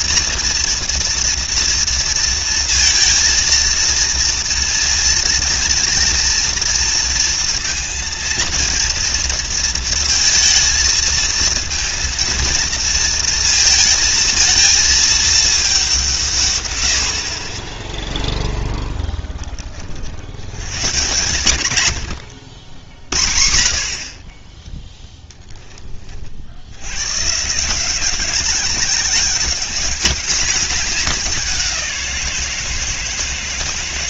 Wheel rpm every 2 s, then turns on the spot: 230, 230, 230, 230, 230, 230, 230, 220, 120, 10, 100, 70, 20, 70, 190, 210, 170.
none